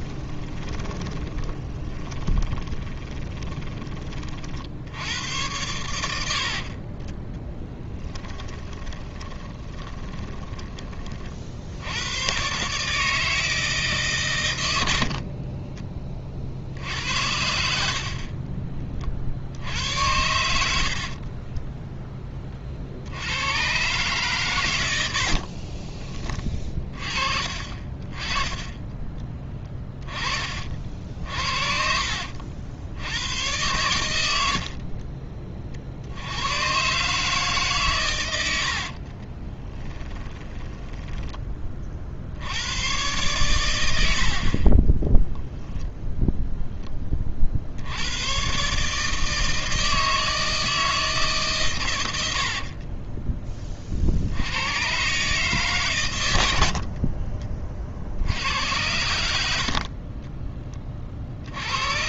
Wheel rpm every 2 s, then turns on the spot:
20, 20, 60, 50, 20, 20, 140, 100, 70, 30, 70, 40, 110, 30, 20, 50, 70, 60, 120, 70, 10, 100, 30, 10, 140, 160, 40, 100, 70, 80, 20.
0-4 6-12 20-22 34-36 38-42 44-46 52-54